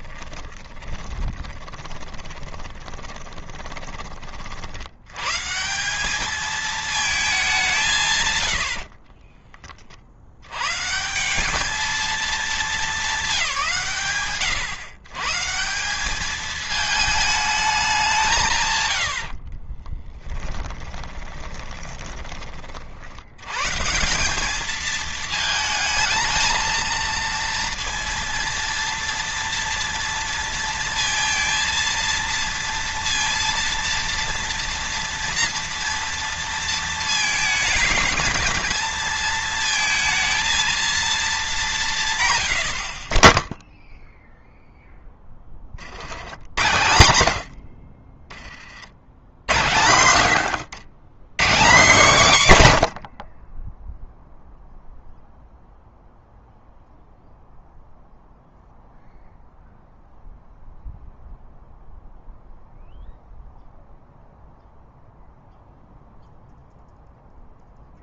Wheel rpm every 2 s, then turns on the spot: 20, 20, 50, 220, 110, 100, 220, 130, 220, 160, 20, 40, 210, 220, 230, 230, 230, 230, 230, 220, 230, 130, 0, 100, 50, 110, 160, 0, 0, 0, 0, 0, 0, 0.
0-4 8-10 20-22 50-52